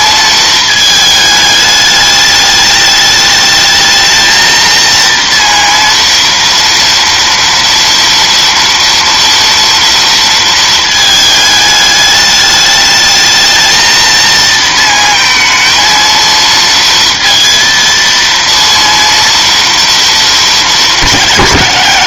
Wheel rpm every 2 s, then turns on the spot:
220, 210, 230, 230, 230, 230, 210, 230, 230, 230, 220.
none